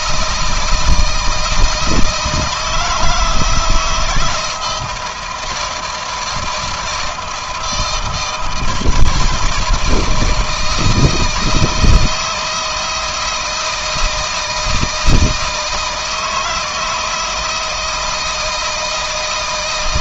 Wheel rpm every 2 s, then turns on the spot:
160, 160, 170, 160, 160, 160, 160, 160, 160, 160.
none